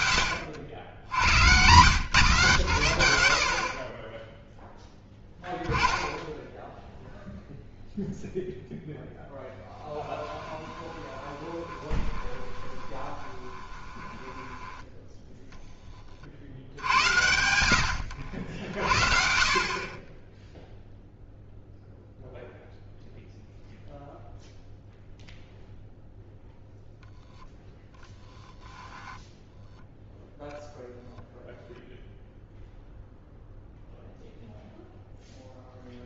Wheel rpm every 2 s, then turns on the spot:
90, 70, 10, 0, 0, 20, 20, 10, 60, 60, 0, 0, 0, 0, 0, 0, 0, 0.
10-16